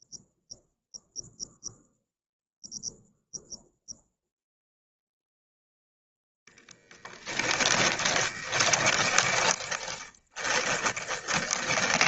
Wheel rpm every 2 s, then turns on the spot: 0, 0, 0, 10, 20, 20.
6-12